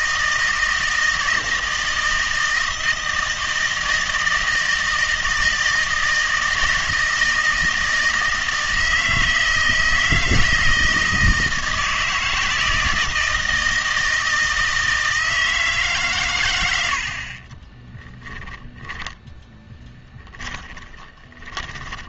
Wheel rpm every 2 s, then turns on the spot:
160, 160, 160, 160, 160, 160, 160, 160, 100, 10, 20.
18-22